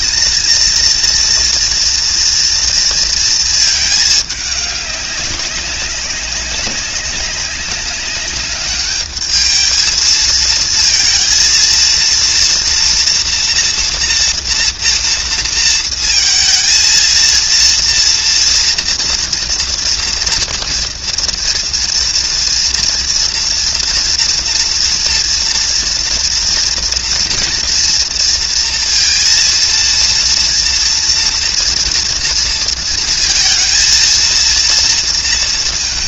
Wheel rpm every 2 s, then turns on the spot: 230, 230, 200, 200, 200, 230, 240, 230, 230, 230, 230, 230, 230, 230, 230, 230, 230, 230.
none